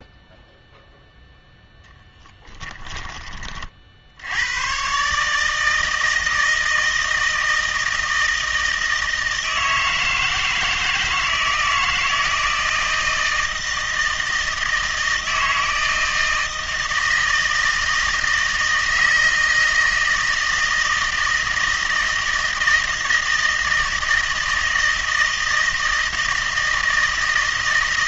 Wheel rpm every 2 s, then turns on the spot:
0, 10, 110, 160, 160, 160, 160, 160, 160, 160, 160, 160, 160, 160.
2-4